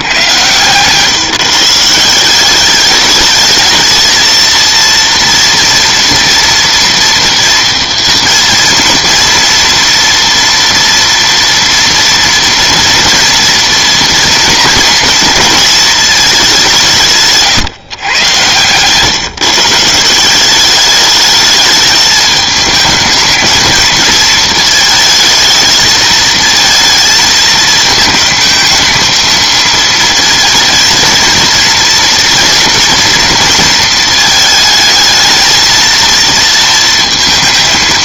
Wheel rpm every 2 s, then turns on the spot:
130, 200, 230, 230, 230, 230, 230, 240, 180, 120, 200, 210, 230, 230, 220, 220, 240, 220, 230.
none